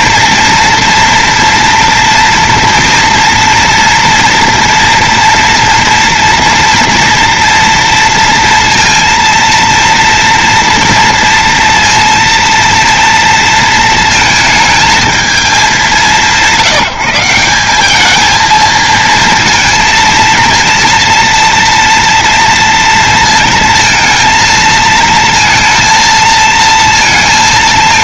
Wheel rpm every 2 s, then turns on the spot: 230, 230, 240, 240, 230, 230, 230, 220, 170, 230, 230, 230, 220, 230.
none